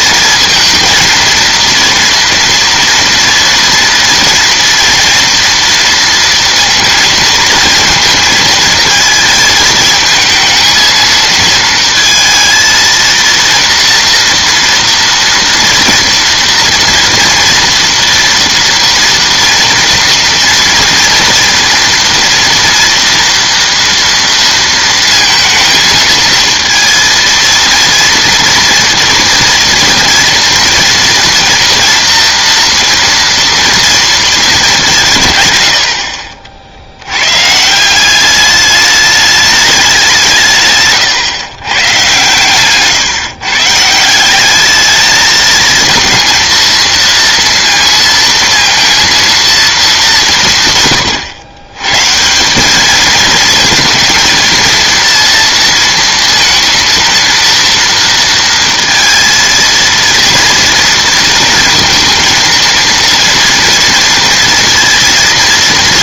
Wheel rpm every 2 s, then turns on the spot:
230, 230, 230, 230, 220, 230, 230, 230, 230, 240, 240, 230, 230, 230, 230, 230, 230, 200, 60, 210, 170, 130, 200, 220, 230, 150, 190, 230, 230, 230, 230, 230, 230.
none